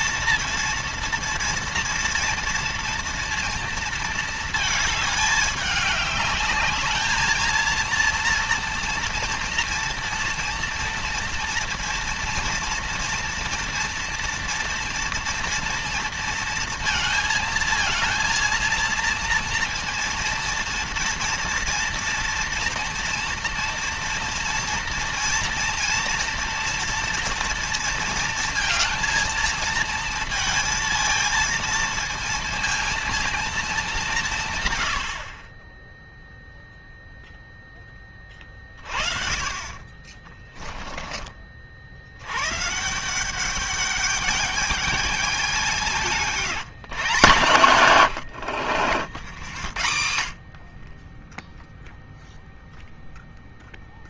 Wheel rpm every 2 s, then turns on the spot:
230, 230, 220, 210, 230, 230, 230, 230, 220, 230, 230, 230, 230, 230, 230, 230, 230, 130, 0, 30, 20, 130, 210, 170, 60, 50, 0.
40-42